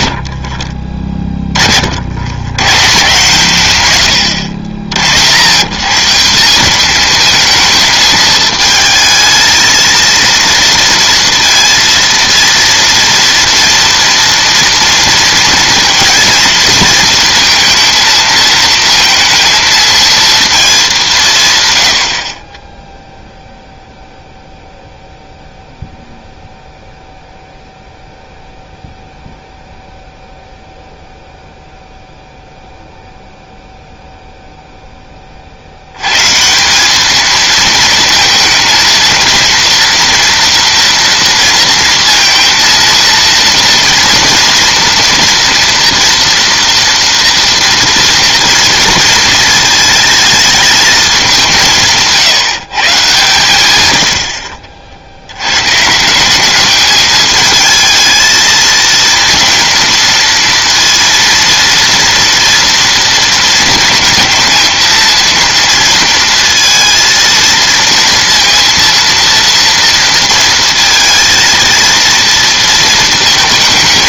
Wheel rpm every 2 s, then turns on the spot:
40, 110, 90, 190, 220, 230, 230, 230, 230, 220, 220, 30, 0, 0, 0, 0, 0, 0, 160, 220, 230, 230, 230, 230, 230, 220, 160, 60, 200, 230, 230, 240, 230, 230, 230, 230, 230.
54-56